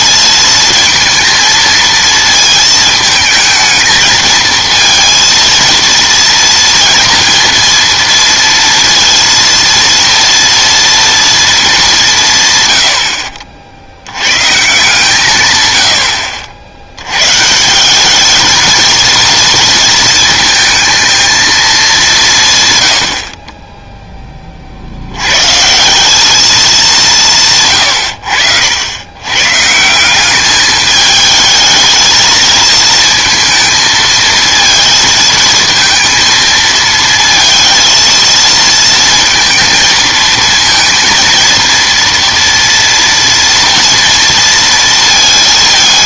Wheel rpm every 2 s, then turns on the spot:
230, 220, 230, 230, 230, 230, 110, 150, 80, 220, 220, 110, 50, 200, 80, 210, 220, 220, 220, 230, 230, 230, 230.
none